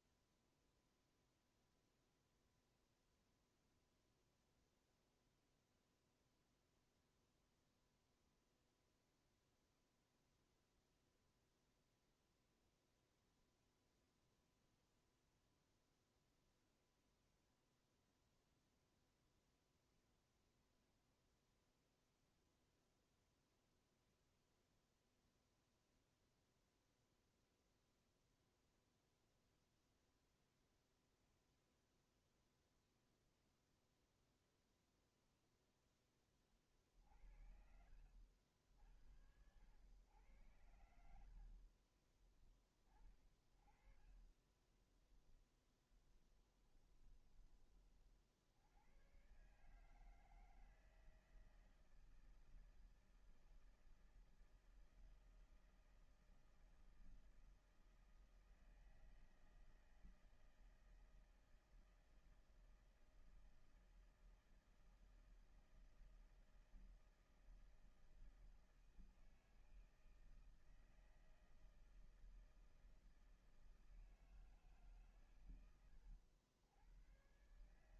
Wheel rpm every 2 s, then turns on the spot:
0, 0, 0, 0, 0, 0, 0, 0, 0, 0, 0, 0, 0, 0, 0, 0, 0, 0, 20, 70, 100, 30, 30, 10, 50, 160, 160, 160, 160, 160, 160, 160, 160, 160, 160, 160, 160, 160, 110.
42-48